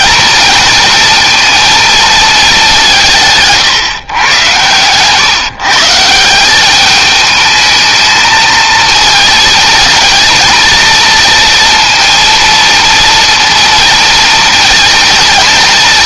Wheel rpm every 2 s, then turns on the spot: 230, 200, 110, 190, 220, 230, 230, 230.
none